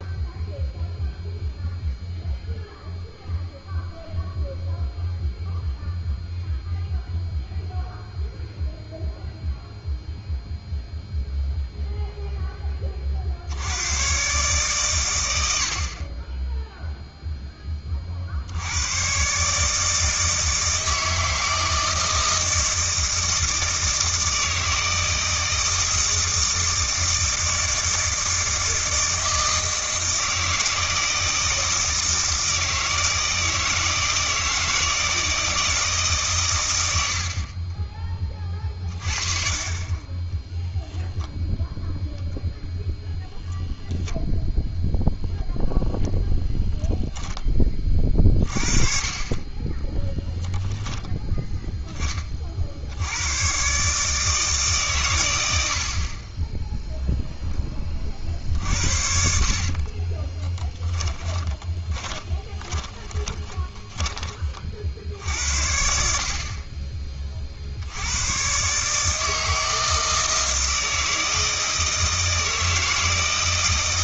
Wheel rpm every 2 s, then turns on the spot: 0, 0, 0, 0, 0, 0, 20, 130, 0, 100, 160, 160, 160, 160, 160, 160, 160, 160, 100, 40, 0, 0, 0, 0, 30, 10, 70, 130, 0, 60, 20, 20, 60, 30, 140, 160, 160.
60-64